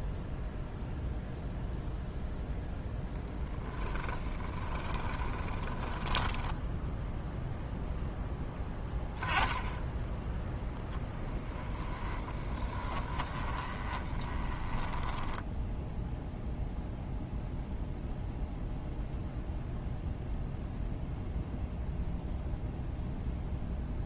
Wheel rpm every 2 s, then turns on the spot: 0, 0, 20, 10, 10, 0, 20, 20, 0, 0, 0, 0.
4-8 12-16